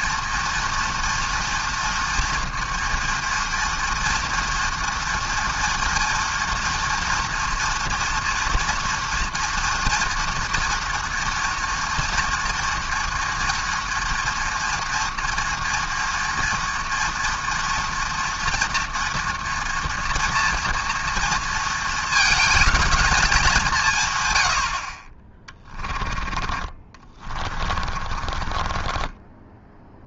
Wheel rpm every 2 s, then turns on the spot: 230, 230, 230, 230, 230, 230, 230, 230, 230, 230, 230, 220, 60, 30, 20.
26-30